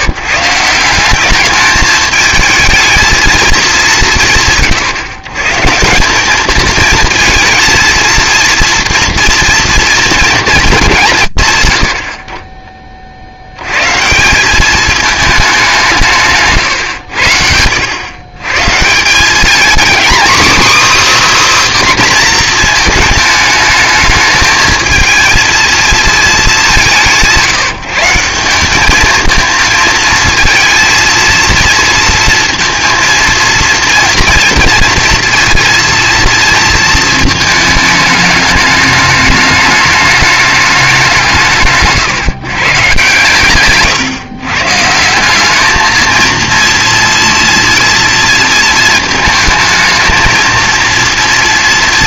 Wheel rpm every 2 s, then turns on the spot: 180, 220, 140, 220, 230, 220, 30, 200, 110, 140, 290, 240, 220, 190, 200, 220, 230, 230, 230, 210, 200, 140, 150, 230, 230, 230.
none